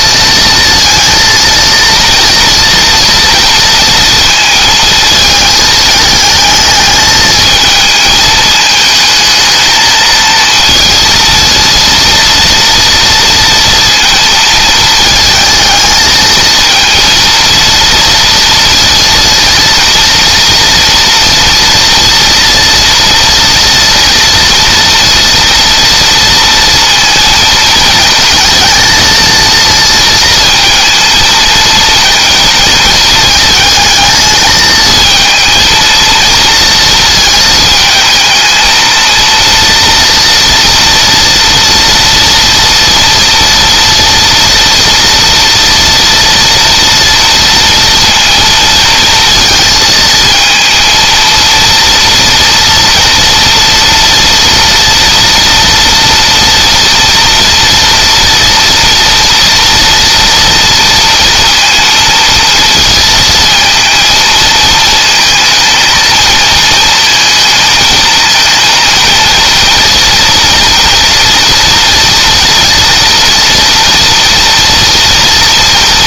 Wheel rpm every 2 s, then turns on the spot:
230, 240, 220, 220, 220, 230, 230, 230, 230, 230, 230, 230, 230, 230, 230, 230, 220, 220, 220, 230, 230, 230, 230, 230, 230, 230, 230, 230, 230, 230, 230, 220, 220, 220, 230, 230, 230, 230.
none